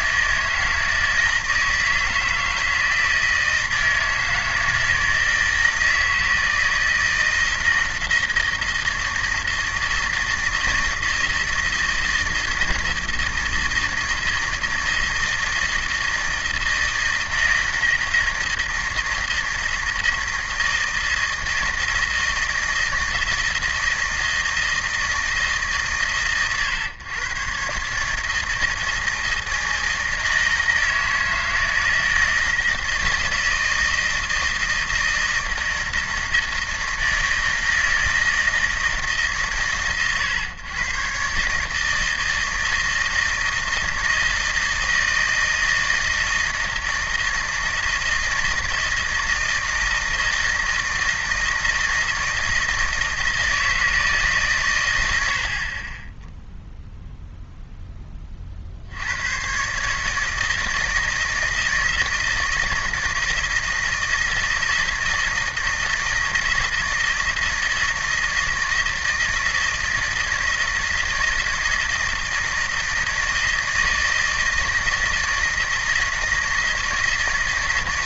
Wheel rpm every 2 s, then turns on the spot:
160, 160, 160, 160, 160, 160, 160, 160, 160, 160, 160, 160, 160, 120, 160, 160, 160, 160, 160, 160, 120, 160, 160, 160, 160, 160, 160, 140, 0, 70, 160, 160, 160, 160, 160, 160, 160, 160, 160.
none